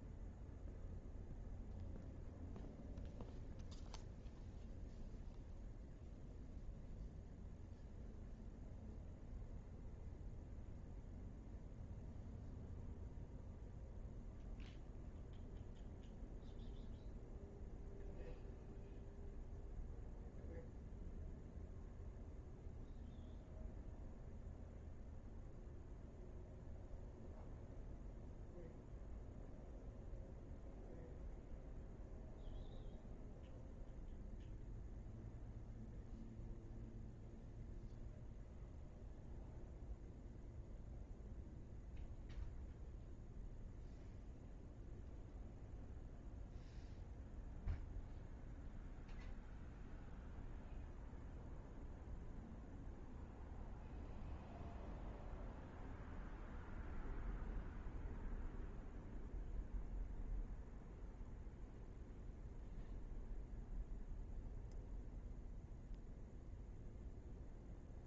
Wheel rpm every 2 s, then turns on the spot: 0, 0, 0, 0, 0, 0, 0, 0, 0, 0, 0, 0, 0, 0, 0, 0, 0, 0, 0, 0, 0, 0, 0, 0, 0, 0, 0, 0, 0, 0, 0, 0, 0, 0.
none